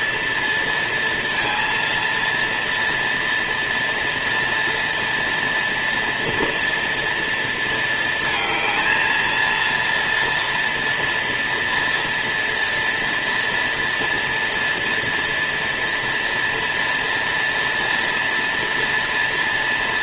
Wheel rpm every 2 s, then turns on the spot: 230, 230, 240, 230, 220, 230, 230, 230, 230, 230.
none